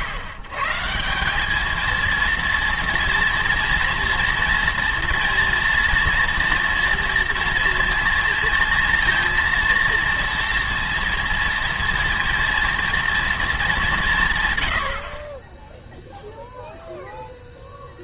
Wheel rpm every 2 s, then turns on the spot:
120, 230, 230, 240, 230, 230, 230, 140, 0.
none